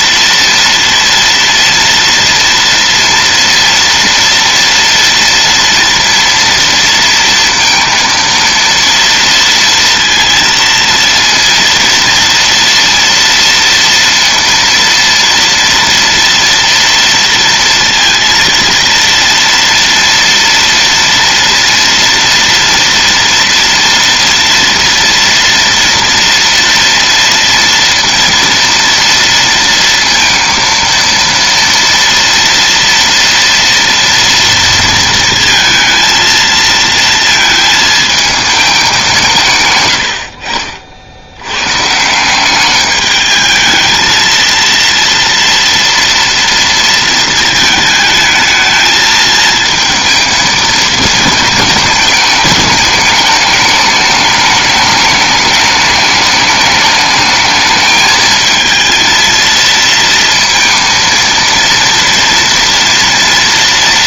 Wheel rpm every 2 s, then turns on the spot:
230, 230, 230, 230, 230, 230, 230, 230, 230, 230, 230, 230, 230, 230, 230, 230, 230, 230, 230, 220, 70, 200, 230, 230, 220, 220, 210, 210, 210, 220, 230, 230.
none